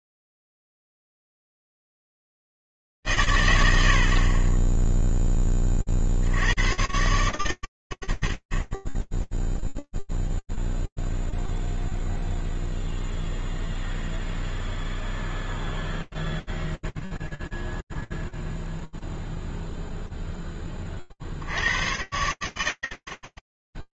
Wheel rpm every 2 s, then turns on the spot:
0, 90, 70, 50, 90, 0, 0, 0, 0, 0, 0, 80.
none